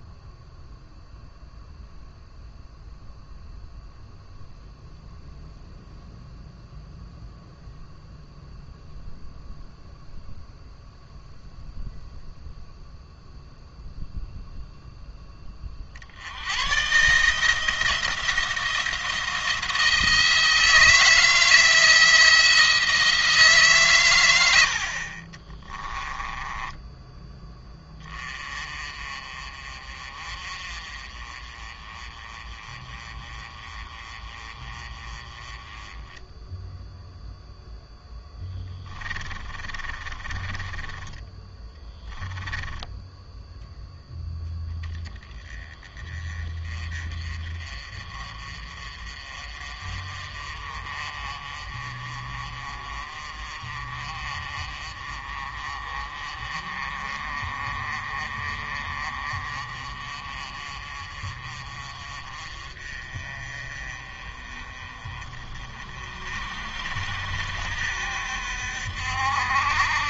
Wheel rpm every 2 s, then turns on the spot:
0, 0, 0, 0, 0, 0, 0, 0, 120, 170, 160, 170, 60, 10, 30, 30, 30, 30, 0, 10, 30, 0, 10, 30, 40, 30, 40, 30, 30, 40, 30, 30, 30, 60, 60.
26-28 38-42